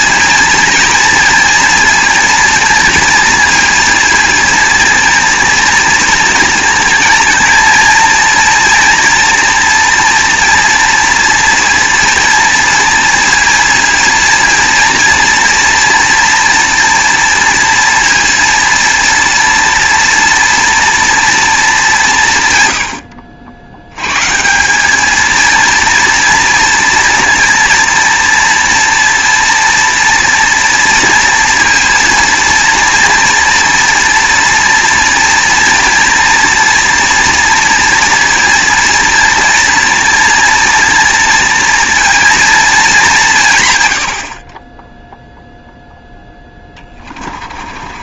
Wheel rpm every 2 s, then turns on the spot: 240, 230, 230, 230, 230, 230, 230, 230, 230, 230, 230, 120, 170, 230, 230, 230, 230, 230, 230, 230, 230, 220, 30, 10.
46-48